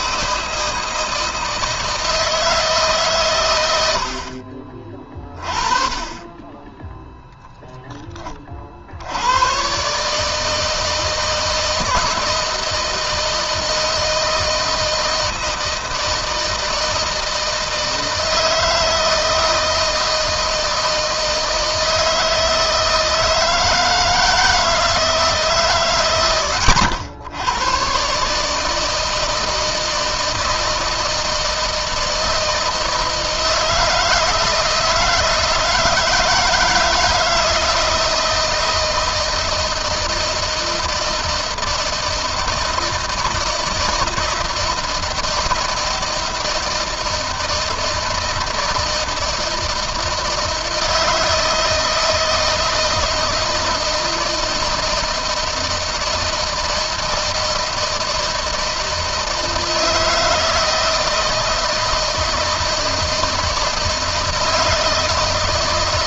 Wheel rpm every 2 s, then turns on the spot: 160, 140, 20, 0, 70, 160, 160, 160, 160, 160, 160, 160, 160, 110, 160, 160, 160, 160, 170, 160, 160, 160, 160, 160, 160, 160, 160, 160, 160, 160, 160, 160, 160.
none